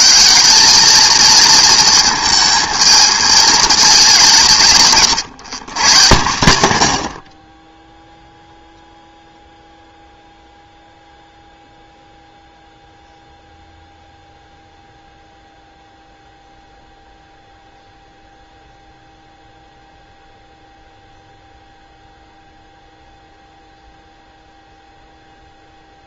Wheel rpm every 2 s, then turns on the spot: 200, 220, 180, 130, 0, 0, 0, 0, 0, 0, 0, 0, 0.
none